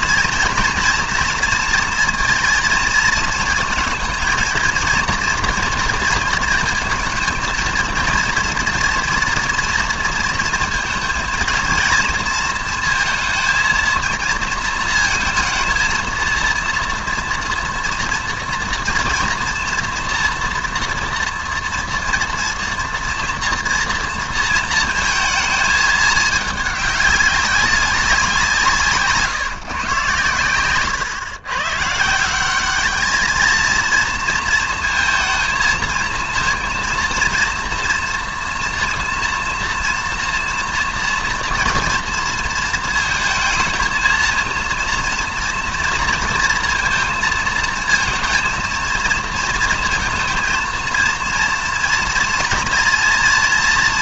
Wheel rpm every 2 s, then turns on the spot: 230, 230, 230, 230, 230, 230, 230, 220, 230, 230, 230, 230, 230, 210, 160, 120, 210, 230, 230, 240, 230, 230, 240, 230, 230, 230, 230.
none